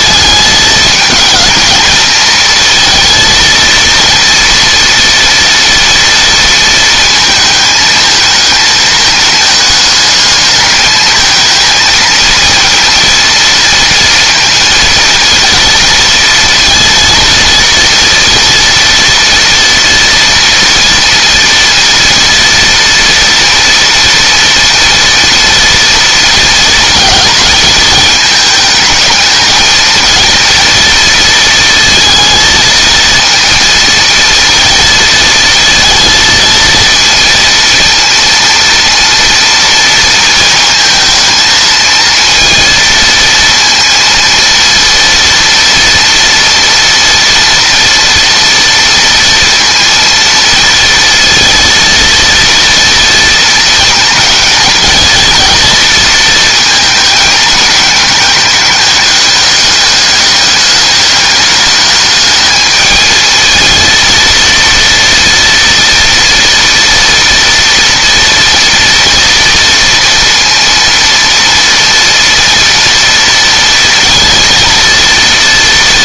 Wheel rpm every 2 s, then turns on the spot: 220, 230, 230, 230, 220, 210, 230, 230, 230, 230, 230, 230, 230, 230, 220, 230, 230, 230, 230, 230, 230, 230, 230, 230, 230, 230, 230, 230, 220, 210, 210, 220, 230, 230, 240, 230, 230, 230.
none